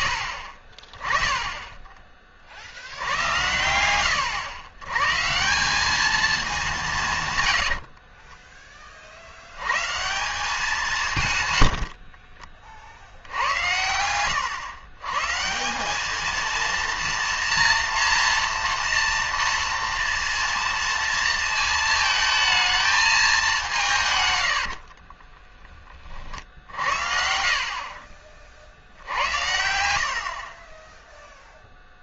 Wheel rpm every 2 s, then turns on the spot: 30, 80, 120, 180, 40, 180, 60, 120, 230, 240, 230, 220, 50, 70, 60, 10.
24-26